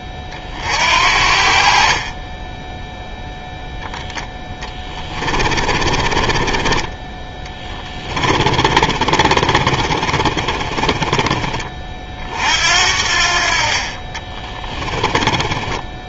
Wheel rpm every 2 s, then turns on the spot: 50, 0, 20, 20, 30, 20, 60, 20.
4-6 8-12 14-16